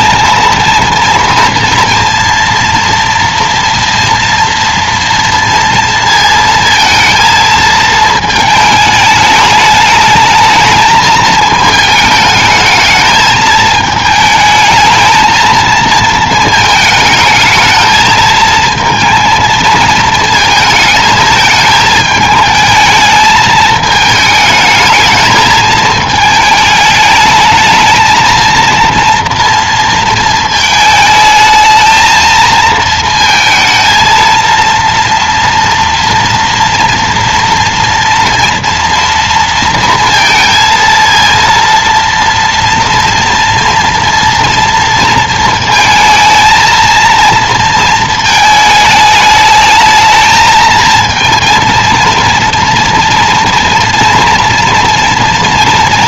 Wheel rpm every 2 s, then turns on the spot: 230, 230, 230, 230, 220, 220, 220, 220, 220, 230, 220, 210, 220, 210, 230, 220, 230, 230, 230, 230, 230, 230, 230, 220, 220, 220, 230, 240.
none